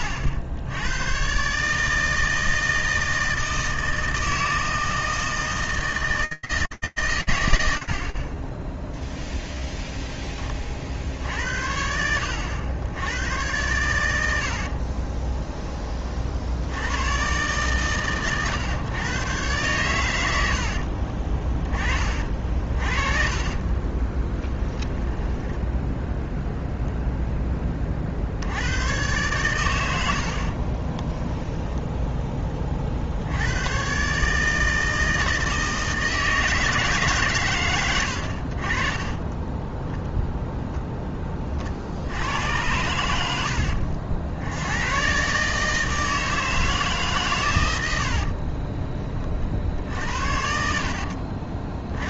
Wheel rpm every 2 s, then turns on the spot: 100, 160, 160, 140, 0, 40, 90, 40, 90, 120, 60, 40, 20, 0, 90, 30, 40, 160, 150, 30, 0, 90, 100, 160, 30, 60.
14-16 20-26 30-32 48-52